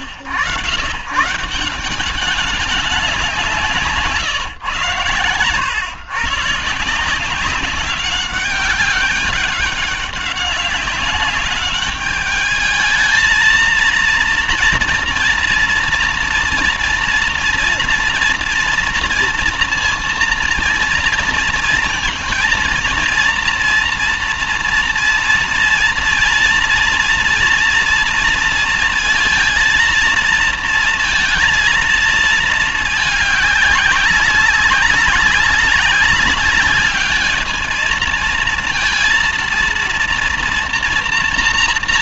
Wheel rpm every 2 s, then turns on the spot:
100, 200, 120, 160, 190, 200, 210, 230, 230, 230, 230, 240, 230, 230, 230, 230, 220, 190, 200, 230, 230.
none